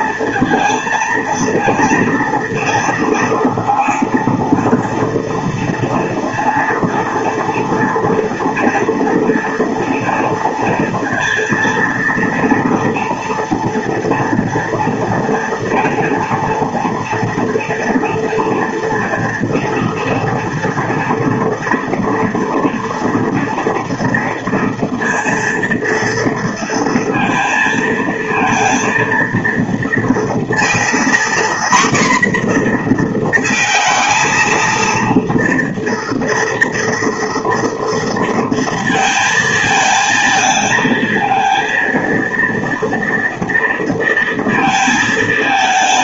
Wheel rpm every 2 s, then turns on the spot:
230, 230, 230, 230, 230, 230, 230, 230, 230, 230, 230, 230, 230, 230, 230, 240, 230, 230, 230, 220, 230, 230, 220.
none